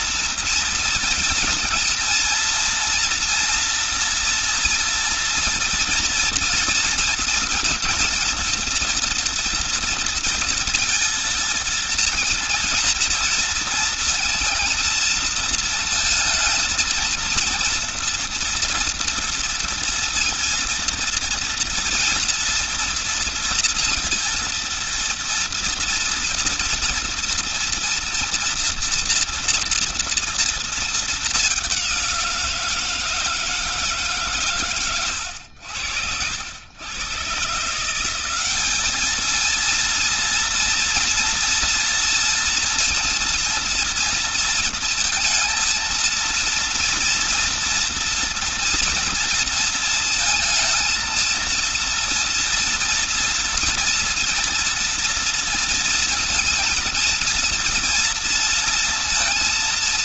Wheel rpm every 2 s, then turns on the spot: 230, 230, 230, 230, 230, 230, 230, 230, 220, 230, 230, 230, 230, 230, 230, 230, 170, 140, 80, 200, 230, 230, 230, 230, 230, 220, 230, 230, 230, 230.
none